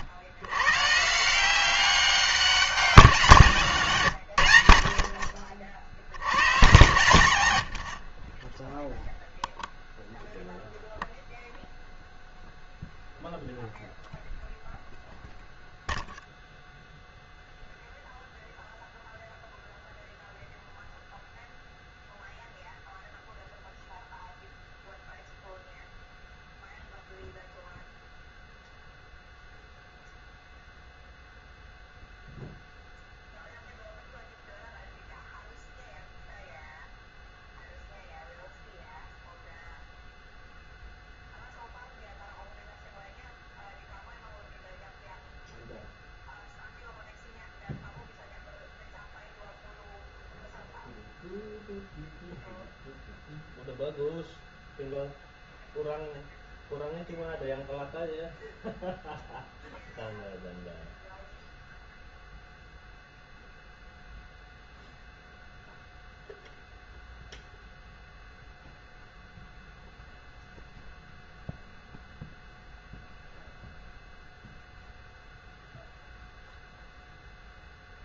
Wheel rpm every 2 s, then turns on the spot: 130, 170, 70, 100, 0, 0, 0, 0, 0, 0, 0, 0, 0, 0, 0, 0, 0, 0, 0, 0, 0, 0, 0, 0, 0, 0, 0, 0, 0, 0, 0, 0, 0, 0, 0, 0, 0, 0, 0.
none